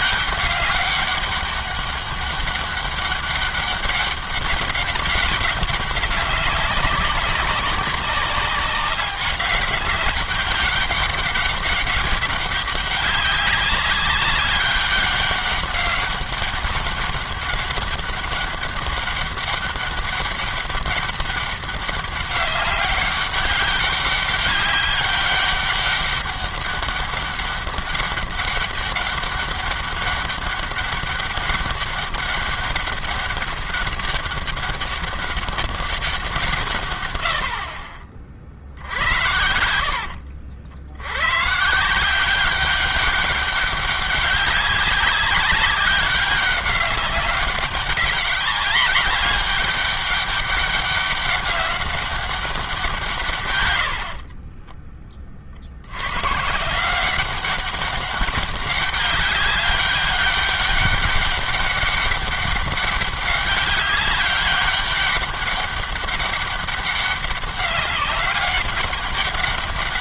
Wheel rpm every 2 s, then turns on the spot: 200, 200, 200, 190, 200, 200, 200, 200, 200, 200, 200, 200, 200, 200, 200, 200, 200, 200, 120, 70, 80, 190, 190, 190, 200, 190, 180, 30, 170, 200, 200, 200, 200, 200, 200.
38-40